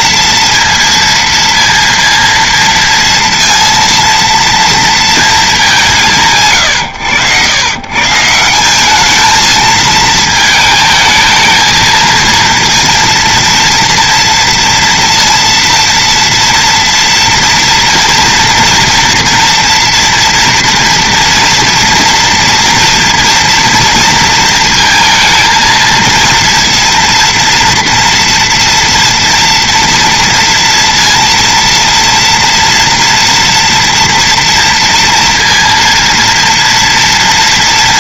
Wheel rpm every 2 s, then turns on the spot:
230, 230, 230, 130, 190, 220, 230, 230, 230, 230, 230, 230, 220, 230, 230, 230, 230, 230, 230.
none